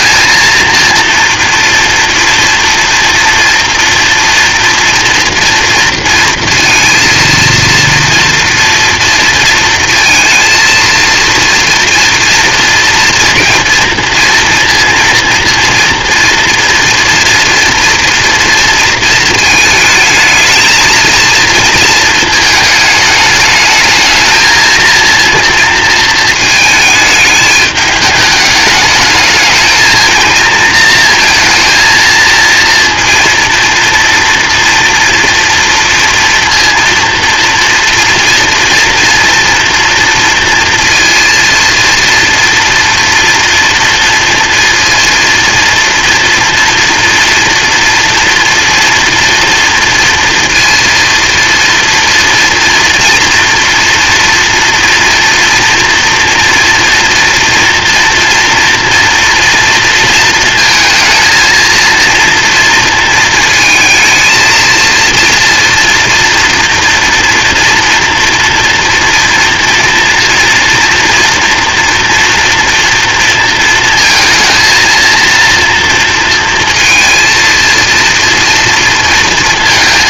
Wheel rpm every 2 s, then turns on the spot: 230, 230, 230, 230, 230, 230, 230, 230, 240, 230, 220, 220, 220, 220, 220, 230, 230, 230, 230, 230, 230, 230, 230, 230, 230, 230, 230, 230, 230, 240, 230, 230, 230, 230, 230, 230, 230, 230, 230, 230.
none